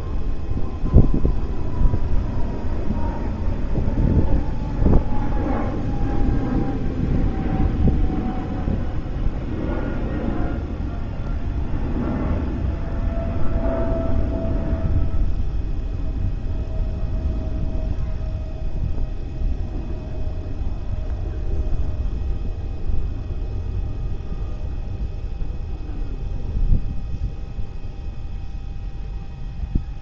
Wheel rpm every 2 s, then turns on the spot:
0, 0, 0, 0, 0, 0, 0, 0, 0, 0, 0, 0, 0, 0, 0.
none